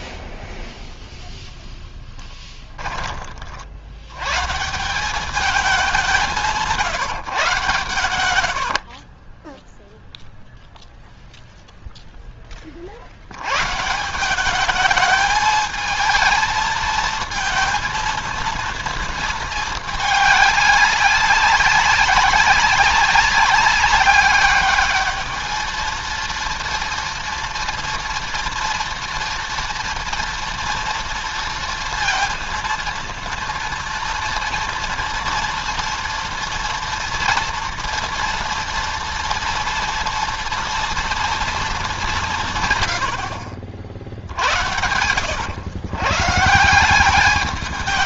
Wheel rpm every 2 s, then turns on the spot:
0, 10, 150, 170, 80, 0, 20, 200, 220, 230, 210, 190, 200, 230, 230, 230, 230, 230, 230, 230, 230, 150, 70, 150.
8-10